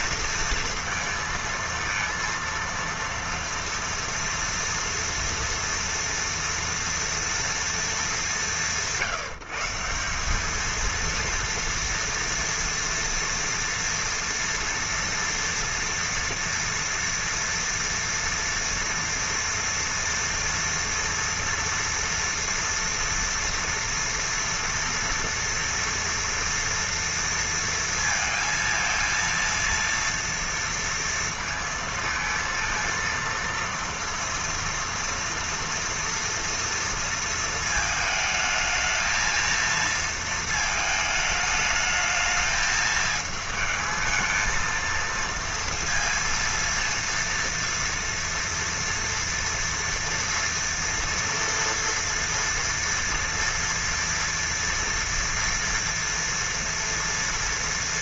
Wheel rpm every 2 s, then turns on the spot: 230, 230, 230, 230, 150, 210, 230, 230, 230, 230, 240, 230, 230, 230, 230, 230, 230, 230, 240, 220, 220, 220, 220, 230, 230, 230, 230, 240, 240.
none